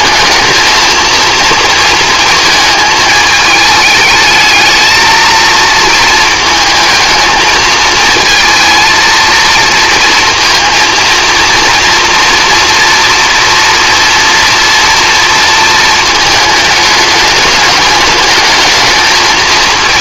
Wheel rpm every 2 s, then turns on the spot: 220, 220, 220, 220, 230, 230, 230, 230, 210, 220.
none